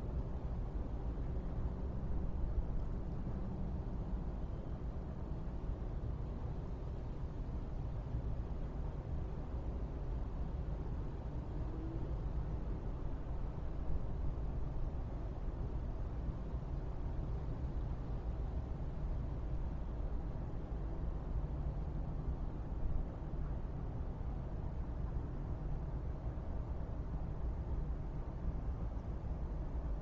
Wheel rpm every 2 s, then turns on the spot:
0, 0, 0, 0, 0, 0, 0, 0, 0, 0, 0, 0, 0, 0, 0.
none